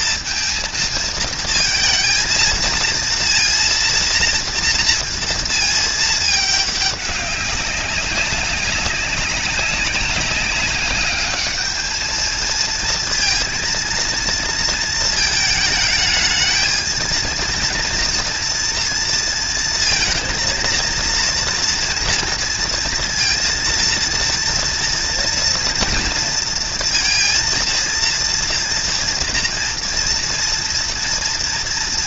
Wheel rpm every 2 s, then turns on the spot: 230, 230, 230, 220, 200, 190, 220, 230, 220, 230, 230, 230, 230, 230, 230, 230.
none